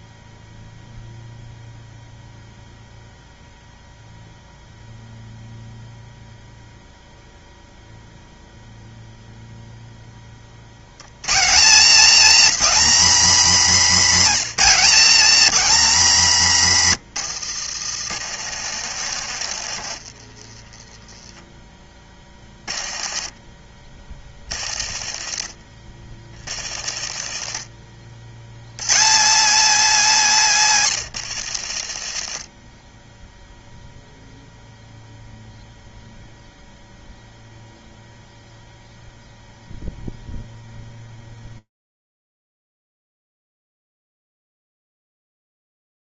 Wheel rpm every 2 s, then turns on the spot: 0, 0, 0, 0, 0, 110, 270, 260, 160, 90, 10, 30, 40, 50, 170, 160, 10, 0, 0, 0, 0, 0, 0.
18-20 22-28 30-32